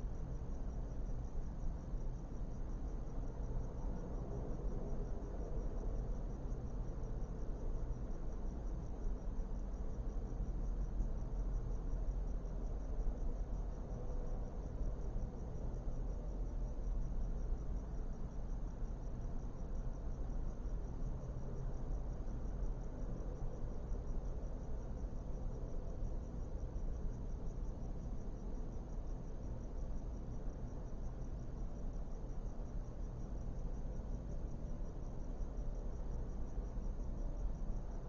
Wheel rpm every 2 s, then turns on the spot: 0, 0, 0, 0, 0, 0, 0, 0, 0, 0, 0, 0, 0, 0, 0, 0, 0, 0, 0.
none